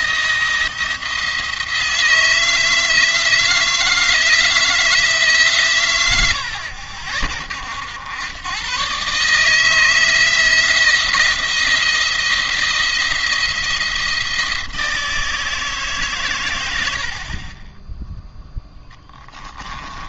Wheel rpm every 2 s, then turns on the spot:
170, 160, 170, 70, 130, 160, 170, 170, 100, 10.
18-20